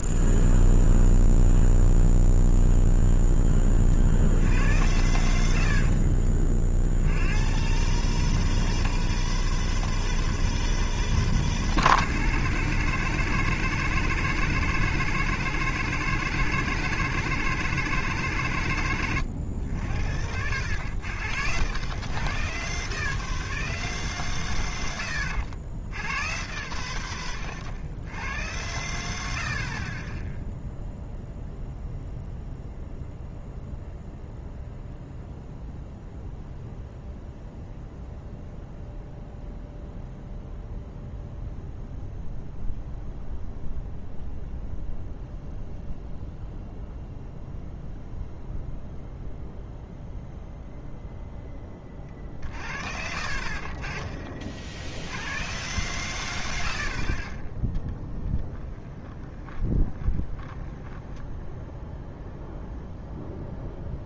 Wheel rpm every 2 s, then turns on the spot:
0, 0, 40, 60, 140, 160, 160, 160, 160, 150, 80, 110, 120, 110, 90, 0, 0, 0, 0, 0, 0, 0, 0, 0, 0, 0, 40, 50, 70, 20, 10, 0.
6-8 52-54 58-62